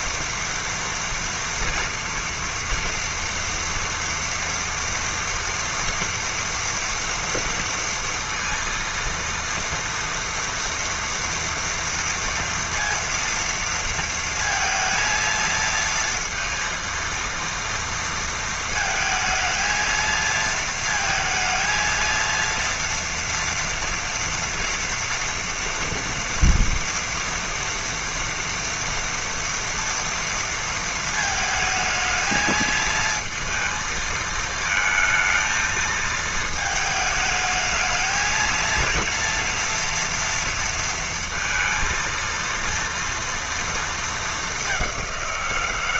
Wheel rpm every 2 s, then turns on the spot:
230, 230, 230, 230, 230, 230, 230, 230, 230, 220, 220, 230, 230, 240, 230, 220, 230, 230, 220, 230, 230, 230, 180.
none